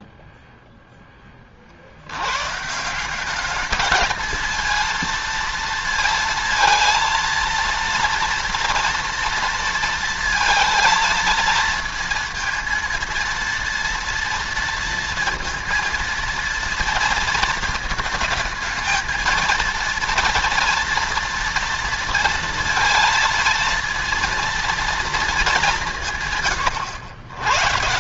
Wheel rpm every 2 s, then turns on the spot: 10, 170, 230, 230, 230, 230, 230, 230, 230, 220, 230, 230, 230, 110.
none